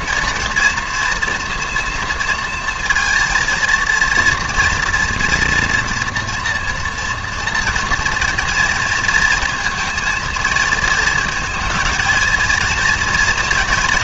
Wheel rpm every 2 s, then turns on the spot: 240, 230, 230, 240, 230, 230, 230.
none